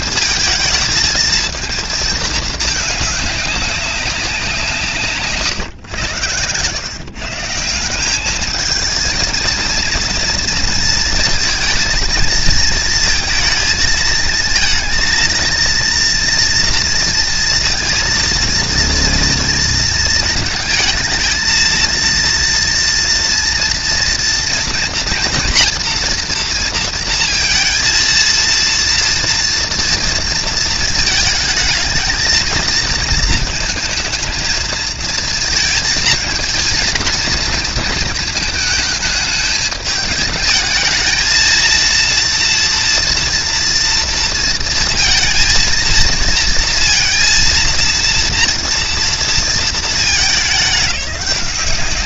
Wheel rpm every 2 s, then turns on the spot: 220, 220, 160, 140, 220, 230, 220, 230, 230, 230, 220, 230, 230, 230, 230, 220, 230, 230, 230, 220, 220, 230, 220, 230, 230, 200.
none